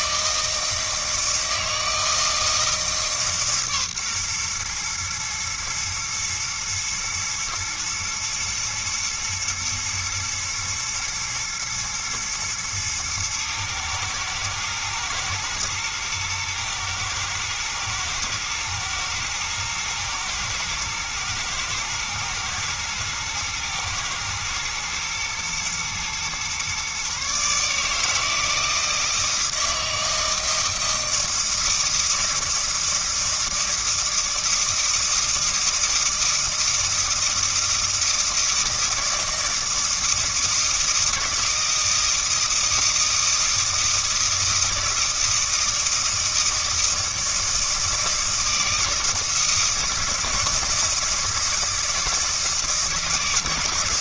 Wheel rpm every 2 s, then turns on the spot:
160, 160, 120, 110, 110, 110, 110, 110, 110, 110, 110, 110, 110, 130, 160, 160, 160, 160, 160, 160, 160, 160, 160, 160, 160, 160, 160.
none